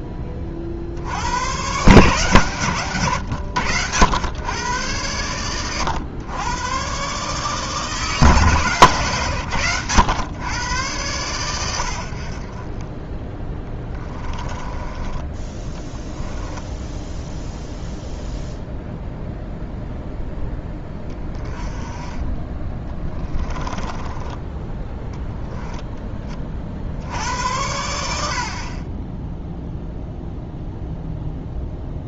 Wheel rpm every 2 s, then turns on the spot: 60, 130, 110, 120, 140, 120, 20, 20, 0, 0, 10, 20, 10, 80, 30, 0.
14-16